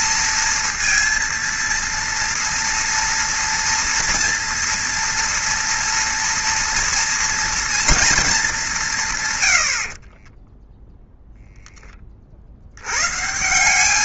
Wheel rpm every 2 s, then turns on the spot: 230, 230, 230, 230, 160, 10, 110.
none